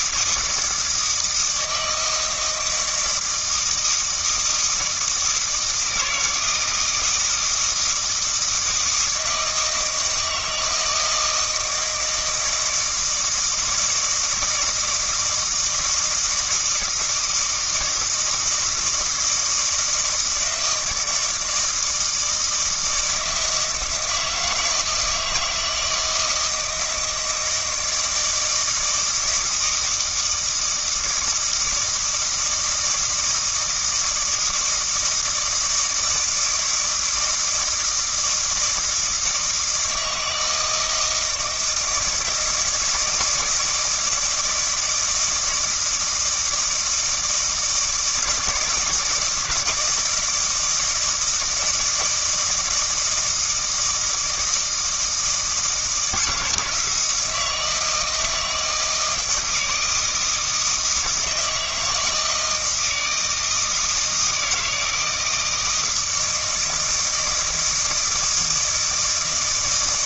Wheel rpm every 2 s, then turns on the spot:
160, 160, 160, 160, 160, 160, 160, 160, 160, 160, 160, 160, 160, 170, 160, 160, 160, 160, 160, 160, 160, 160, 170, 160, 160, 160, 160, 160, 160, 160, 160, 160, 160, 160, 160.
none